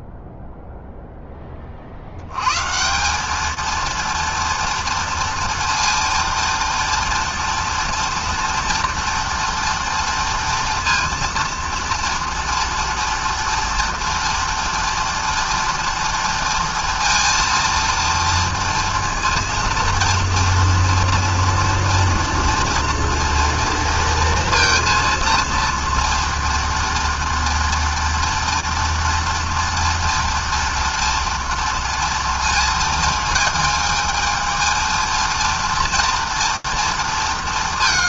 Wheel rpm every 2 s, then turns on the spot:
0, 120, 230, 230, 240, 230, 230, 230, 230, 230, 230, 230, 230, 230, 230, 230, 230, 220, 230.
none